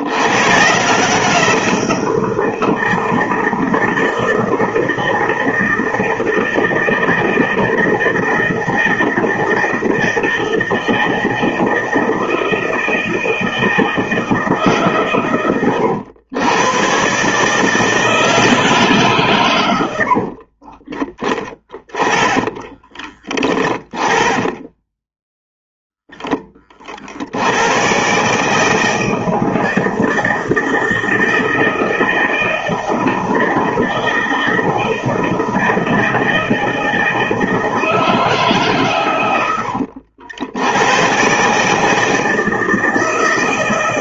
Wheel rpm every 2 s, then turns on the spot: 160, 170, 160, 160, 160, 160, 160, 130, 130, 140, 30, 20, 10, 50, 160, 160, 160, 160, 160, 120, 120, 160.
20-26